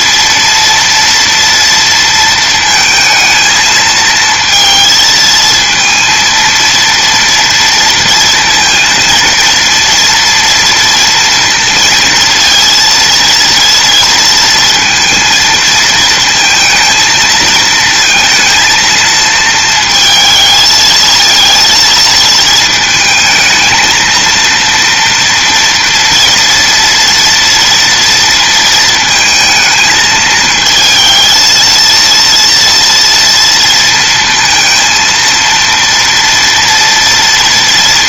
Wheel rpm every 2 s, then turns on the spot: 230, 230, 230, 230, 230, 230, 230, 230, 230, 230, 220, 220, 230, 240, 230, 220, 230, 230, 230.
none